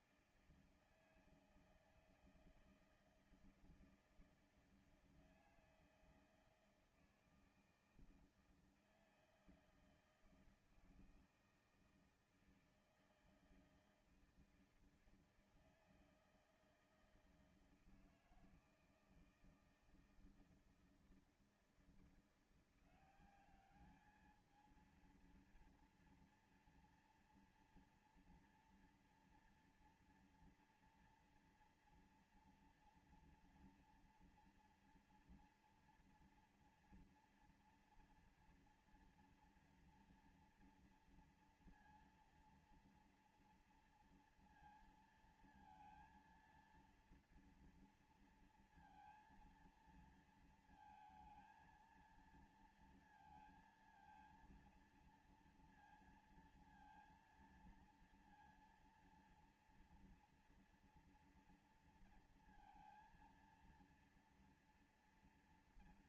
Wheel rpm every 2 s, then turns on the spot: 160, 160, 160, 160, 160, 160, 160, 160, 160, 160, 160, 180, 220, 230, 240, 230, 230, 230, 230, 230, 230, 230, 230, 230, 230, 230, 230, 230, 230, 230, 230, 230, 230.
none